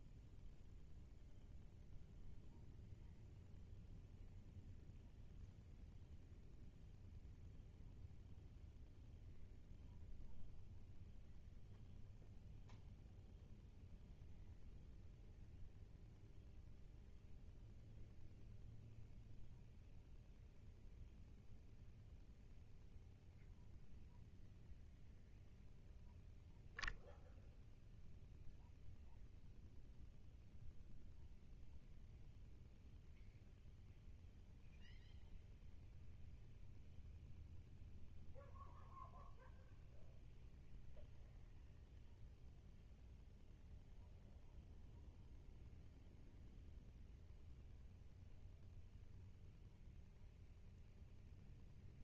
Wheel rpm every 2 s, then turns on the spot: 0, 0, 0, 0, 0, 0, 0, 0, 0, 0, 0, 0, 0, 0, 0, 0, 0, 0, 0, 0, 0, 0, 0, 0, 0, 0.
none